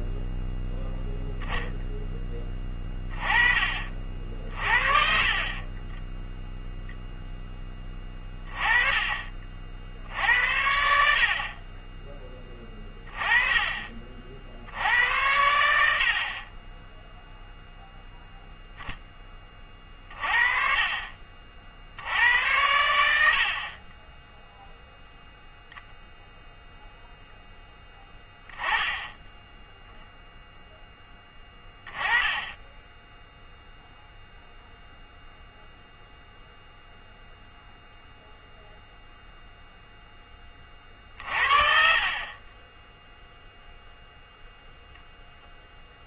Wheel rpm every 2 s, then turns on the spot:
0, 20, 50, 0, 30, 70, 20, 70, 20, 0, 40, 100, 0, 0, 10, 0, 10, 0, 0, 0, 20, 0, 0.
none